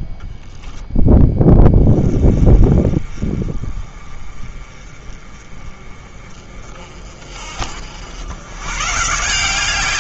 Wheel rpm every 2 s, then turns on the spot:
0, 30, 30, 40, 130.
none